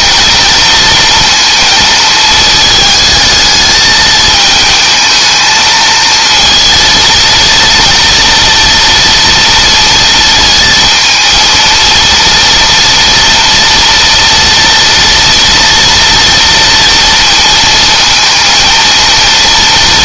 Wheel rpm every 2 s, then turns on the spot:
230, 220, 220, 230, 230, 220, 230, 230, 230, 230.
none